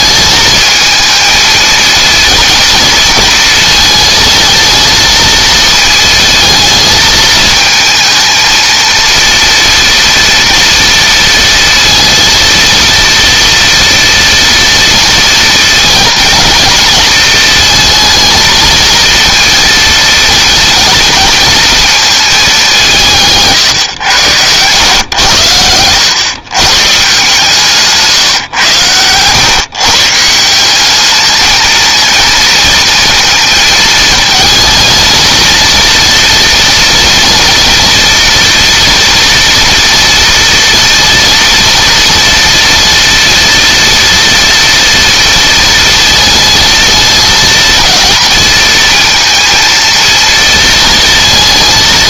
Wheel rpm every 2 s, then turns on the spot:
220, 230, 230, 220, 230, 230, 230, 230, 230, 220, 230, 180, 110, 130, 110, 190, 230, 230, 230, 230, 230, 230, 230, 230, 230, 230.
none